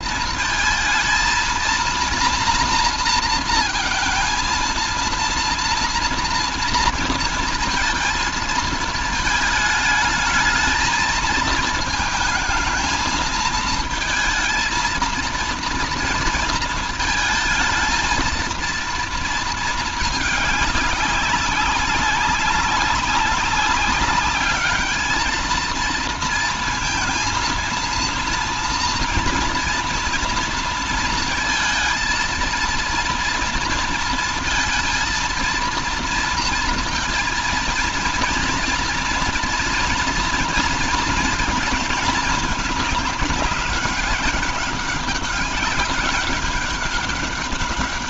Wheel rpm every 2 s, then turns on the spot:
230, 230, 230, 230, 230, 220, 220, 230, 230, 230, 200, 200, 210, 220, 230, 230, 230, 230, 230, 230, 230, 210, 200, 200.
none